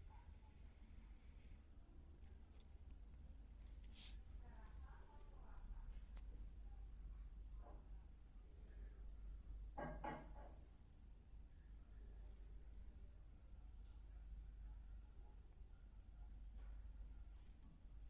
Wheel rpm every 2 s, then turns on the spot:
0, 0, 0, 0, 0, 0, 0, 0, 0.
none